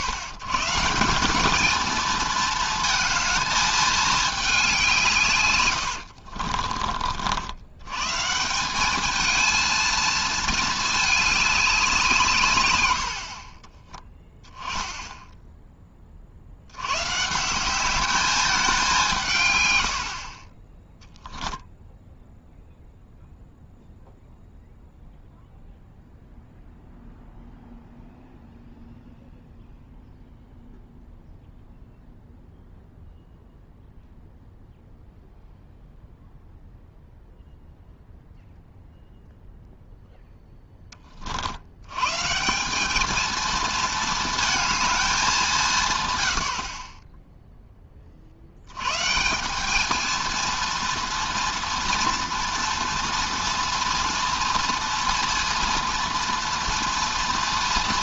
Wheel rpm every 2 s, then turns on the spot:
150, 230, 200, 50, 180, 220, 120, 10, 80, 200, 30, 0, 0, 0, 0, 0, 0, 0, 0, 0, 10, 190, 220, 60, 90, 240, 240, 230, 230.
6-8